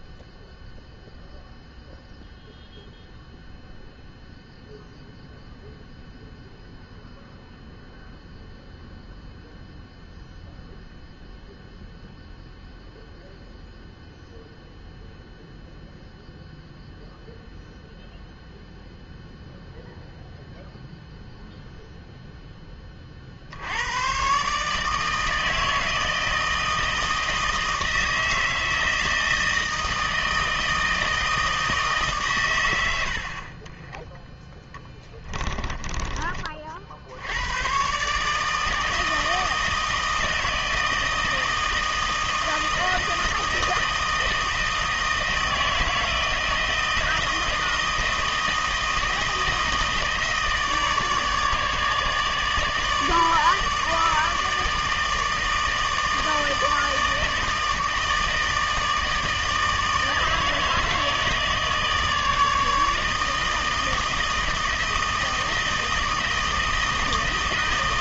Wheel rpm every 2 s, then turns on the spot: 0, 0, 0, 0, 0, 0, 0, 0, 0, 0, 0, 10, 150, 160, 160, 160, 120, 10, 50, 160, 160, 160, 160, 160, 160, 160, 160, 160, 160, 150, 160, 150, 160, 160.
none